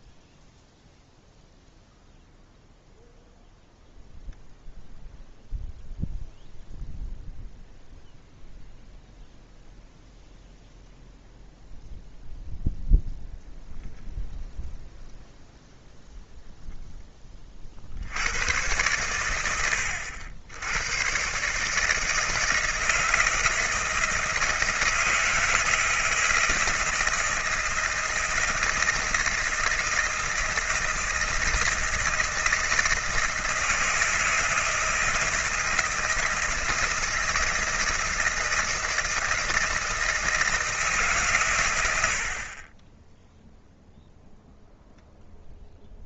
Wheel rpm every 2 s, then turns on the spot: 0, 0, 0, 0, 0, 0, 0, 0, 10, 110, 110, 160, 160, 160, 160, 160, 160, 160, 160, 160, 150, 20, 0.
none